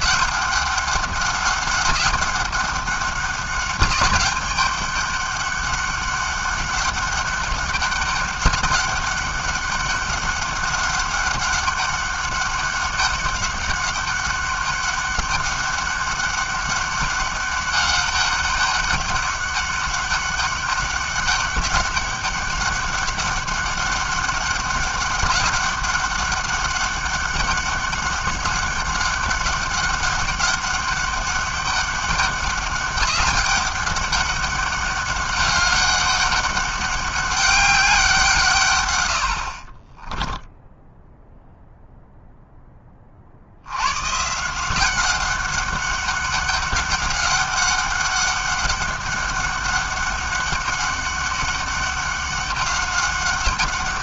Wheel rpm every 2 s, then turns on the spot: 200, 200, 200, 200, 200, 200, 200, 200, 200, 200, 200, 200, 200, 200, 200, 200, 200, 200, 200, 140, 10, 0, 170, 200, 200, 200, 200.
none